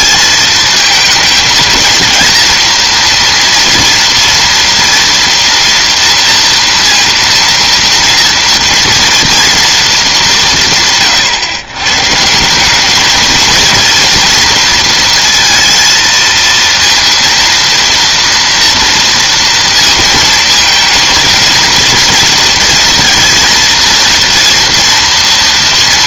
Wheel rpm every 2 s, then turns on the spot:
230, 230, 230, 230, 240, 190, 170, 230, 230, 230, 230, 230, 230.
none